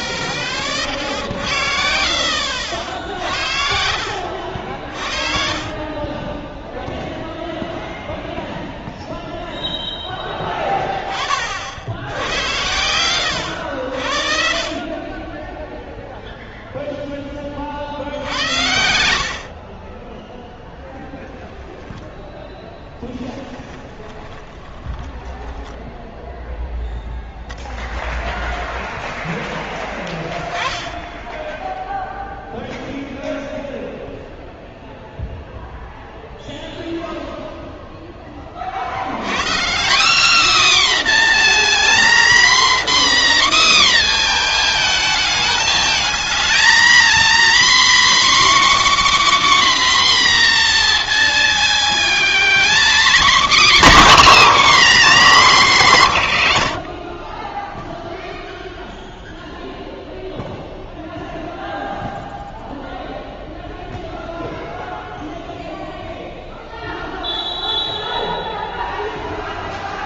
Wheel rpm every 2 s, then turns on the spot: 30, 70, 60, 10, 0, 10, 80, 40, 0, 70, 10, 10, 20, 0, 0, 20, 0, 0, 0, 30, 280, 260, 240, 230, 280, 250, 230, 300, 130, 0, 0, 0, 0, 0, 0.
4-8 22-26